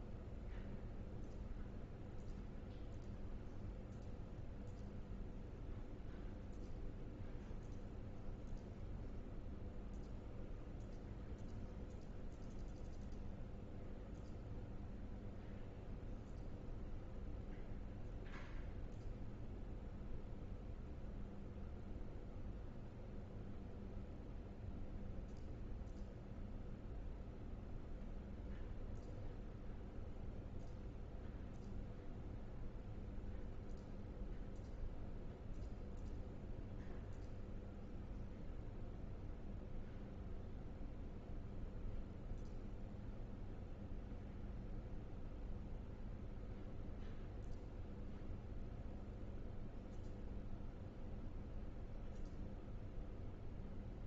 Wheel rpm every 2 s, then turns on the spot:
0, 0, 0, 0, 0, 0, 0, 0, 0, 0, 0, 0, 0, 0, 0, 0, 0, 0, 0, 0, 0, 0, 0, 0, 0, 0, 0.
none